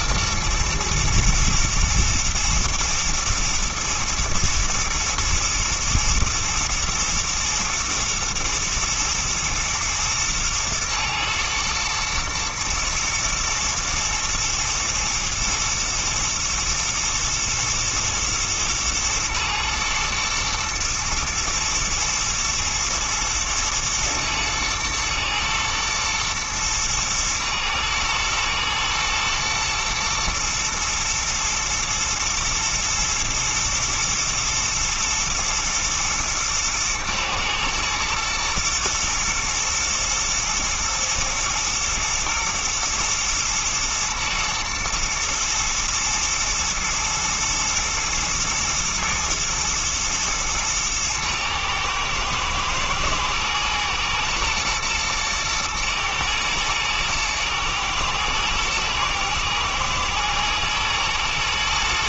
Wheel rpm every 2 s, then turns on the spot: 110, 120, 120, 120, 120, 110, 120, 110, 120, 120, 120, 110, 110, 120, 110, 120, 110, 110, 120, 120, 110, 120, 110, 110, 120, 110, 120, 110, 110, 120, 120.
none